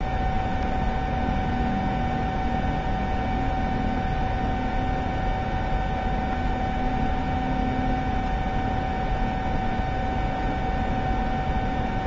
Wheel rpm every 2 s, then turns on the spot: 0, 0, 0, 0, 0, 0.
none